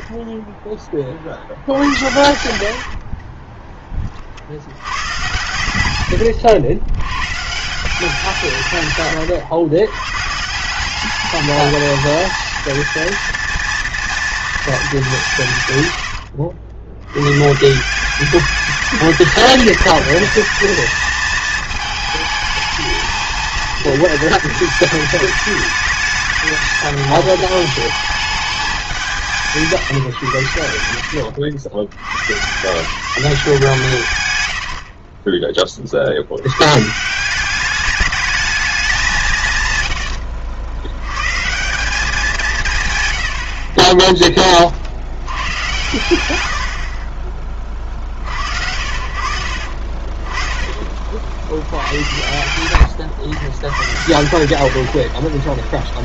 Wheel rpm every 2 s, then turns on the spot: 10, 80, 80, 90, 150, 160, 230, 220, 70, 200, 220, 220, 220, 210, 190, 80, 130, 90, 100, 210, 80, 170, 30, 90, 60, 20, 100, 80.
2-4 34-36 50-52 54-56